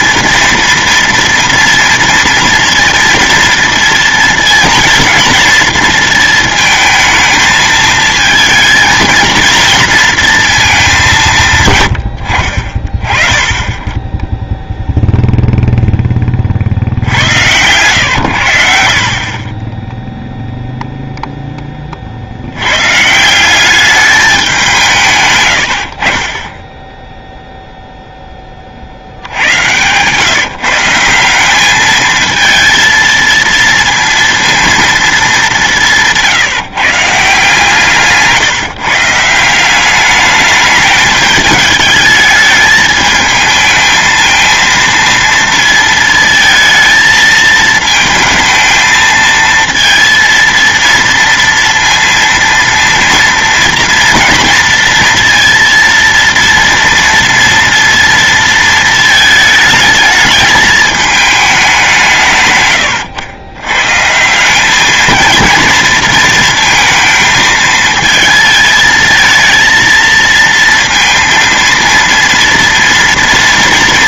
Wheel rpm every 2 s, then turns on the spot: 230, 230, 230, 220, 230, 210, 50, 0, 60, 60, 0, 100, 170, 10, 50, 160, 230, 230, 150, 150, 210, 210, 230, 230, 220, 230, 230, 230, 230, 220, 210, 120, 210, 220, 220, 230, 230.
none